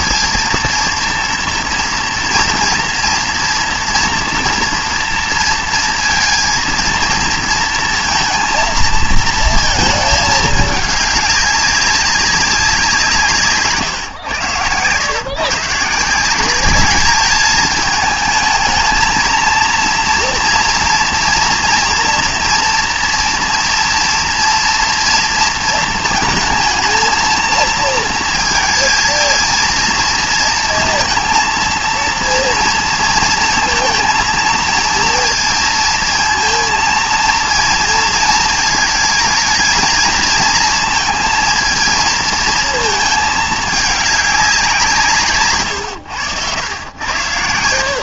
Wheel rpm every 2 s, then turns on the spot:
230, 230, 230, 230, 230, 210, 180, 120, 200, 220, 230, 230, 230, 220, 220, 230, 230, 230, 230, 220, 220, 220, 180, 90.
none